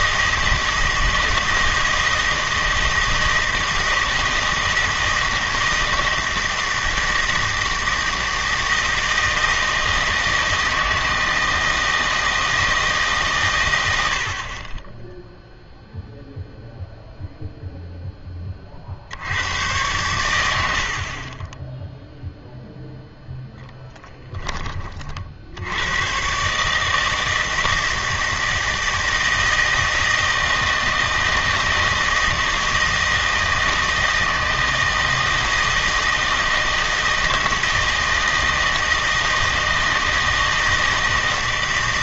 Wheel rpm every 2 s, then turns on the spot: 160, 160, 160, 170, 160, 160, 160, 20, 0, 40, 80, 0, 40, 150, 160, 160, 160, 160, 160, 160, 160.
none